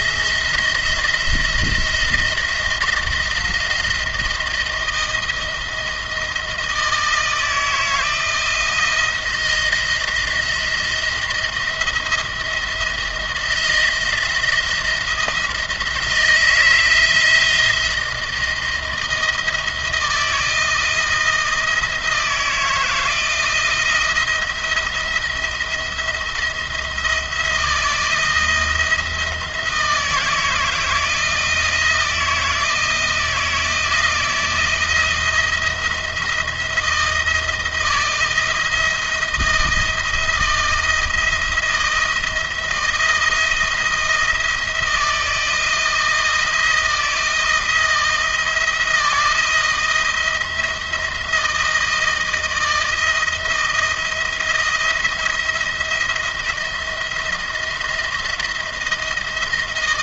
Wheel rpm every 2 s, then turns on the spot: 160, 170, 160, 160, 160, 170, 170, 170, 160, 160, 160, 160, 170, 170, 170, 160, 170, 170, 170, 170, 170, 160, 170, 160, 160, 160, 160, 170, 160, 160.
none